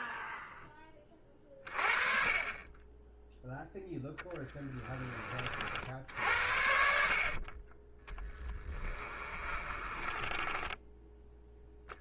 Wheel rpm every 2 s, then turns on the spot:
20, 10, 20, 60, 20, 10.
8-12